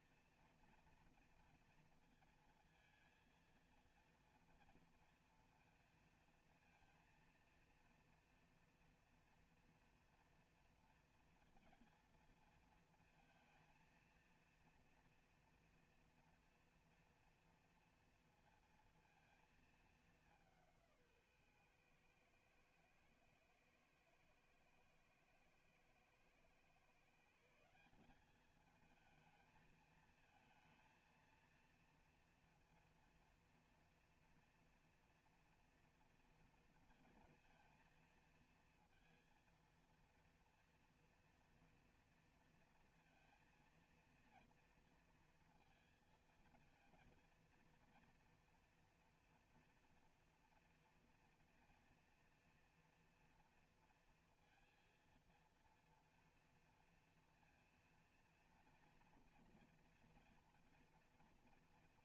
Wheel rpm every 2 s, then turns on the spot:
230, 220, 230, 230, 230, 230, 230, 230, 230, 230, 200, 110, 110, 110, 210, 220, 230, 230, 230, 230, 230, 240, 230, 230, 240, 230, 230, 230, 230, 230, 230.
none